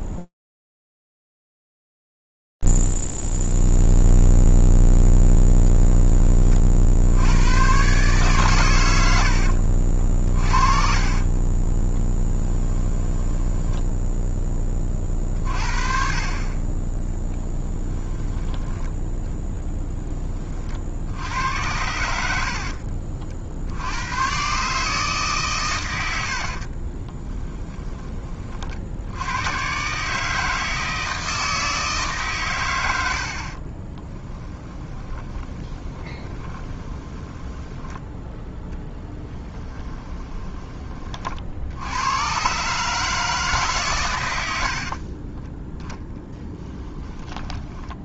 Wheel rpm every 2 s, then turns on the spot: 0, 0, 0, 20, 130, 40, 10, 10, 40, 10, 40, 60, 140, 20, 80, 160, 70, 10, 10, 10, 40, 150, 30, 20.
10-14 18-20 22-24 26-28 34-40 44-46